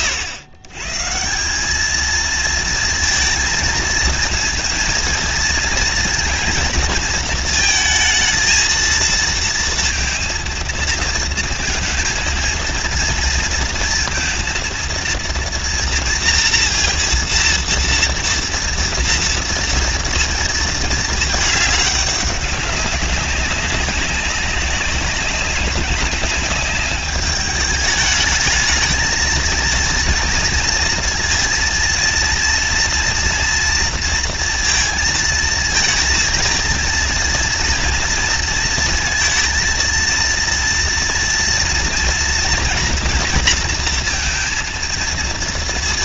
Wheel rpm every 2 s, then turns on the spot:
110, 230, 230, 230, 220, 230, 230, 230, 230, 230, 220, 200, 190, 200, 220, 220, 230, 230, 230, 230, 230, 230, 230.
none